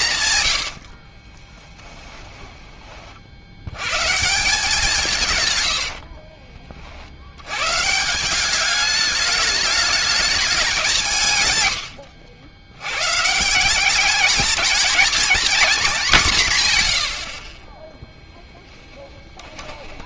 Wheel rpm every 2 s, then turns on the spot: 90, 30, 180, 30, 200, 200, 80, 210, 140, 10.
0-4 16-20